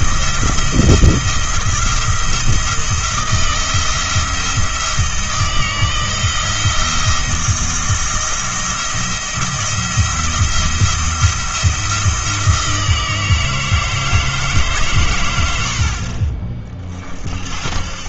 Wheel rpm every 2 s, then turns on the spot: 170, 170, 170, 160, 170, 170, 160, 140, 40.
none